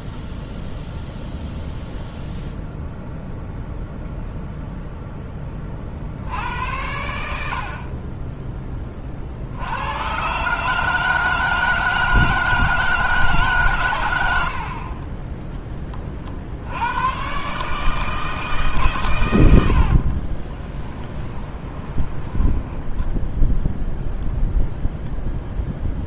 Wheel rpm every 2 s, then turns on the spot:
0, 0, 0, 90, 20, 150, 160, 60, 70, 150, 20, 10, 0.
20-24